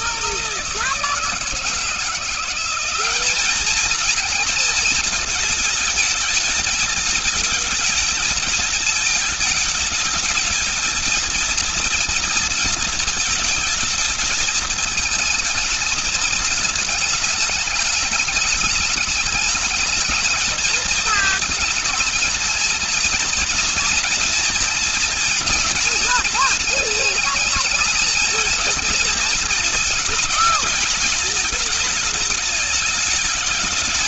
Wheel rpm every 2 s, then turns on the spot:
160, 190, 220, 220, 220, 230, 230, 220, 220, 210, 220, 220, 230, 220, 230, 220, 220.
none